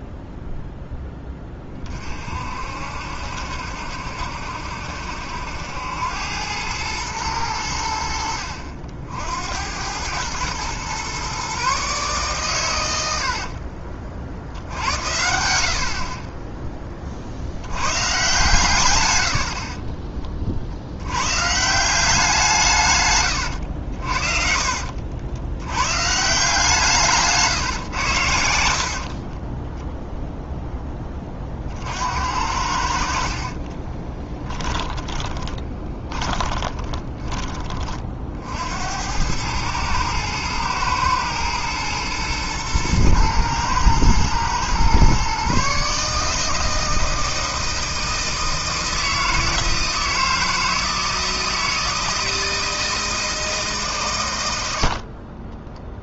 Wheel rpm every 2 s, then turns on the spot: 0, 60, 70, 100, 60, 120, 120, 70, 20, 130, 50, 150, 60, 160, 80, 10, 70, 10, 20, 70, 110, 110, 120, 160, 160, 160, 160, 80.
24-26 28-30 34-38